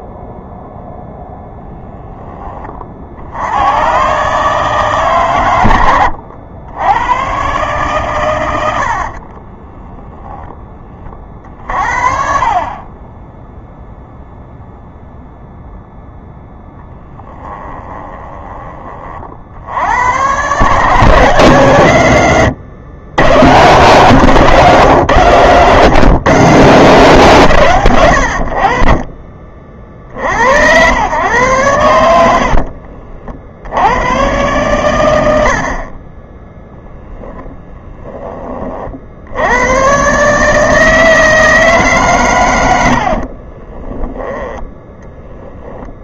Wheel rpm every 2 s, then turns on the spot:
0, 40, 140, 100, 80, 30, 10, 0, 0, 30, 150, 120, 150, 160, 50, 100, 50, 110, 0, 50, 160, 80, 10.
32-34